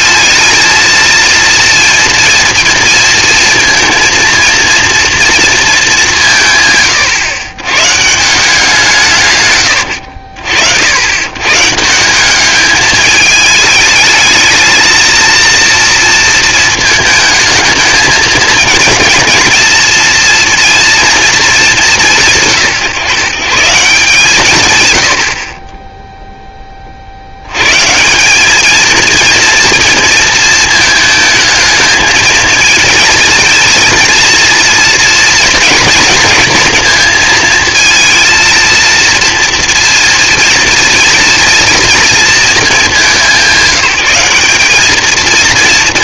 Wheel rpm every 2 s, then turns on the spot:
220, 230, 230, 160, 170, 70, 200, 220, 230, 220, 230, 160, 140, 10, 200, 230, 220, 230, 230, 230, 230, 220, 190.
none